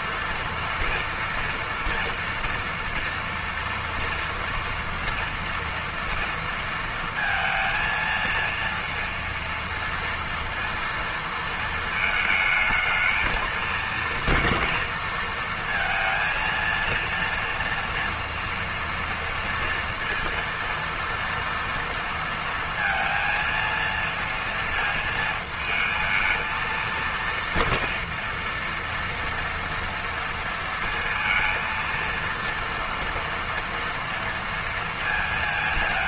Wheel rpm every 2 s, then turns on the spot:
230, 230, 230, 230, 230, 230, 220, 230, 230, 230, 230, 230, 230, 230, 230, 230, 230, 230.
none